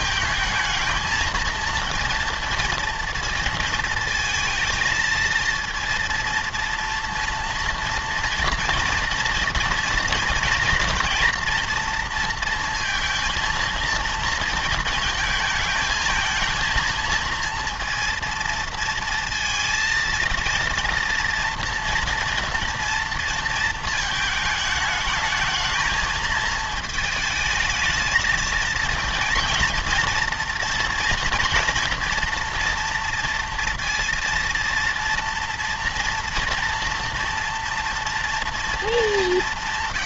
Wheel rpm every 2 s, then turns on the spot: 220, 230, 230, 230, 230, 240, 230, 220, 220, 230, 230, 230, 220, 220, 230, 230, 230, 230, 240, 230.
none